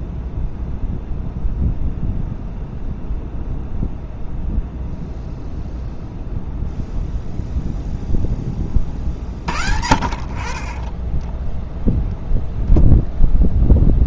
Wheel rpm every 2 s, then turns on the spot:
0, 0, 0, 0, 30, 30, 0.
none